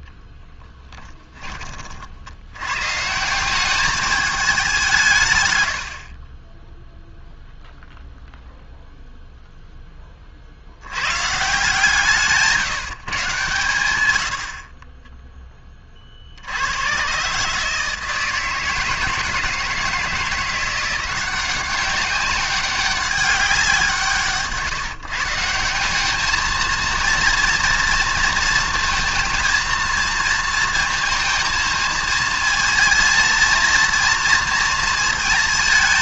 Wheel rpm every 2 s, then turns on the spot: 10, 120, 200, 10, 0, 60, 160, 40, 90, 160, 170, 190, 140, 220, 230, 230, 220, 230.
0-2